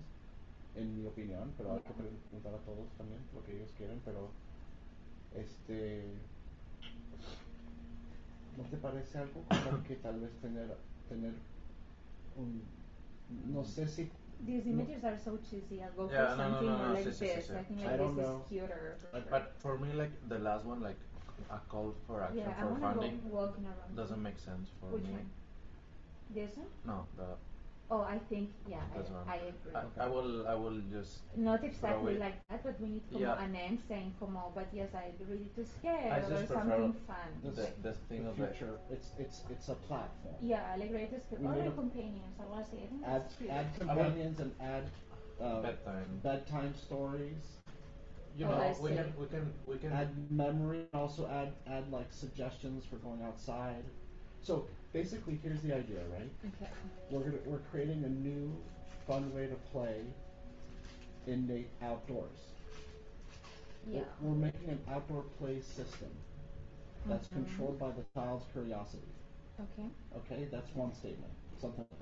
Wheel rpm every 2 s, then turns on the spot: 0, 0, 0, 0, 0, 0, 0, 0, 0, 0, 0, 0, 0, 0, 0, 0, 0, 0, 0, 0, 0, 0, 0, 0, 0, 0, 0, 0, 0, 0, 0, 0, 0, 0, 0, 0.
none